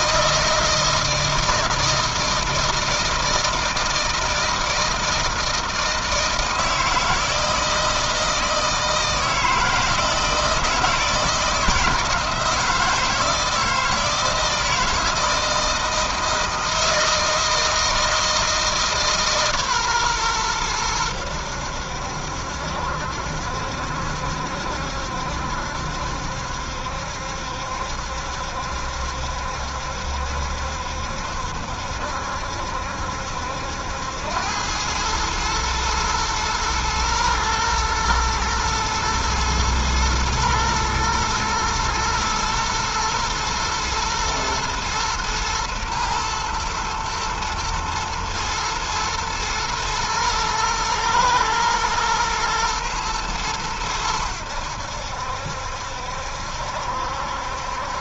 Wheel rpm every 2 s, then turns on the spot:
160, 160, 160, 160, 160, 160, 160, 160, 160, 160, 110, 70, 70, 70, 70, 70, 70, 100, 120, 110, 110, 120, 120, 120, 120, 110, 110, 80, 70.
none